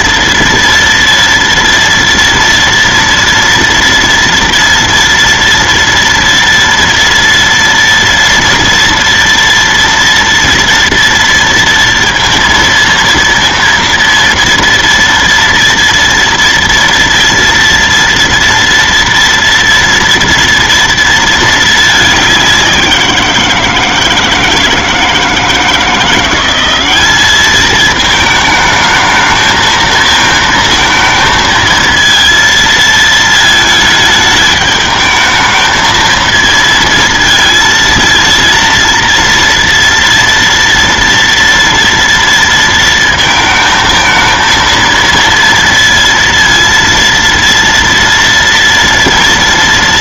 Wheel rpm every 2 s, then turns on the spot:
230, 230, 230, 230, 230, 230, 230, 230, 230, 230, 230, 190, 160, 190, 210, 220, 230, 220, 230, 230, 230, 230, 230, 230, 230.
none